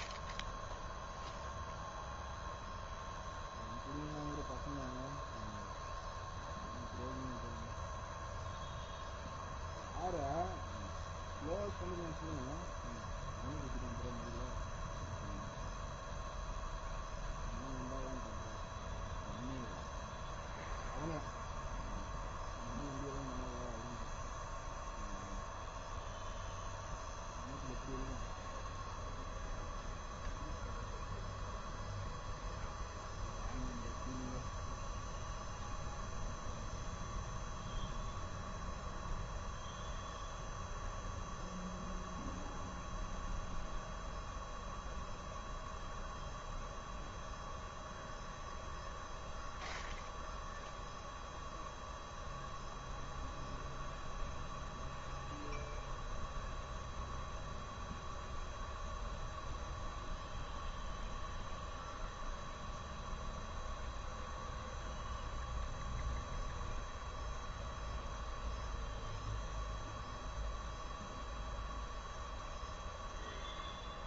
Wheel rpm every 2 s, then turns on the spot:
0, 0, 0, 0, 0, 0, 0, 0, 0, 0, 0, 0, 0, 0, 0, 0, 0, 0, 0, 0, 0, 0, 0, 0, 0, 0, 0, 0, 0, 0, 0, 0, 0, 0, 0, 0, 0.
none